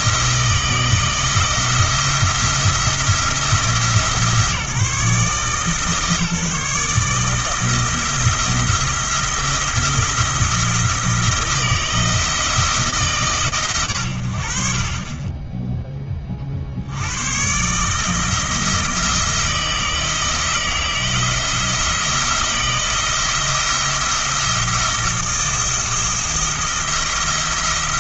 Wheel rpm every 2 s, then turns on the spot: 170, 170, 150, 150, 170, 170, 160, 50, 60, 170, 160, 170, 170, 170.
none